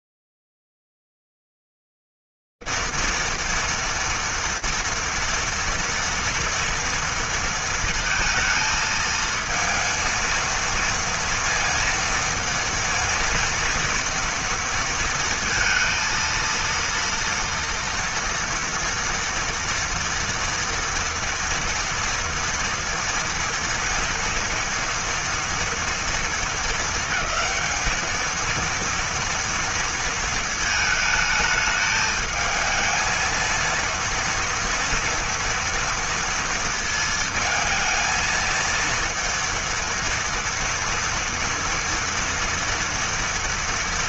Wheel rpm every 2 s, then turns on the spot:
110, 230, 230, 230, 230, 230, 230, 230, 230, 230, 240, 230, 230, 200, 230, 220, 220, 230, 220, 230, 230, 230.
none